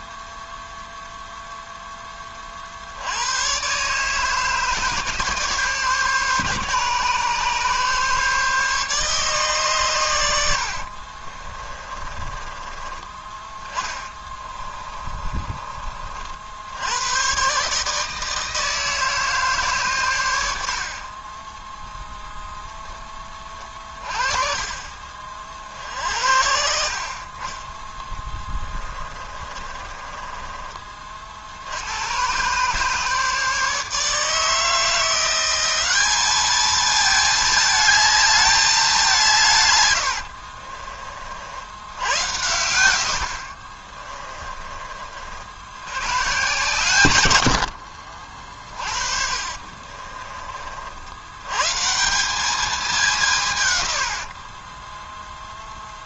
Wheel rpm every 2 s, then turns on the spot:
0, 80, 150, 140, 150, 40, 20, 30, 110, 160, 30, 20, 40, 50, 30, 40, 140, 170, 220, 200, 50, 80, 50, 120, 40, 80, 180, 10.
10-12 14-16 28-30 48-50